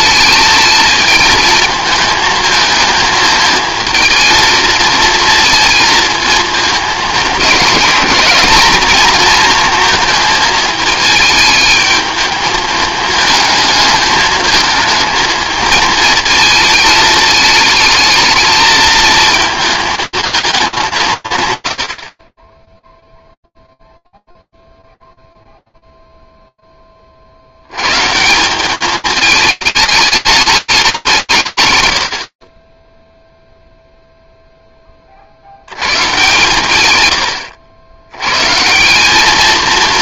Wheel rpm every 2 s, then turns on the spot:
220, 220, 220, 220, 220, 220, 220, 220, 220, 220, 210, 10, 0, 0, 180, 210, 40, 10, 120, 150.
none